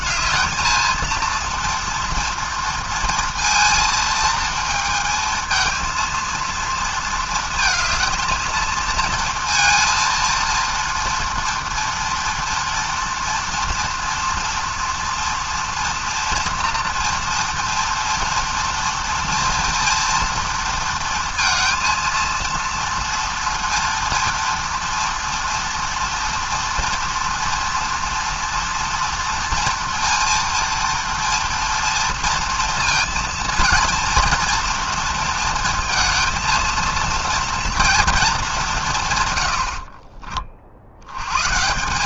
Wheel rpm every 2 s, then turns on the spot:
220, 230, 220, 230, 230, 230, 230, 240, 230, 240, 230, 230, 230, 230, 230, 230, 230, 230, 230, 170, 60.
none